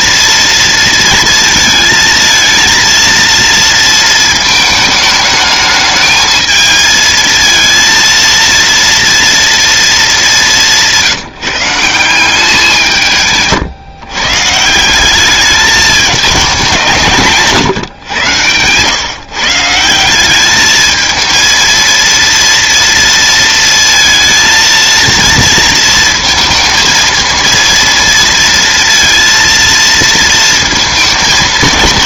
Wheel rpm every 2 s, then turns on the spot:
230, 230, 220, 220, 230, 170, 170, 170, 190, 120, 210, 230, 230, 230, 230, 220.
none